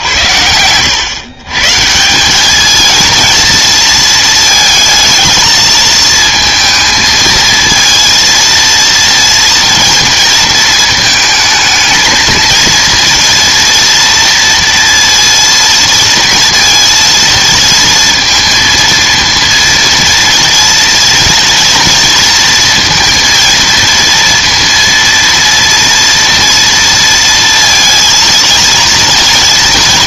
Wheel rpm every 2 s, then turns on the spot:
100, 220, 230, 220, 230, 220, 230, 230, 230, 230, 230, 230, 230, 230, 230.
none